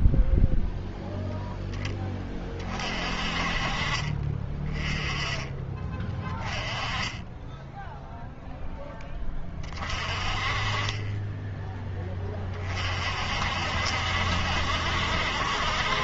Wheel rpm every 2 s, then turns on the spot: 0, 30, 30, 20, 0, 30, 30, 70.
6-8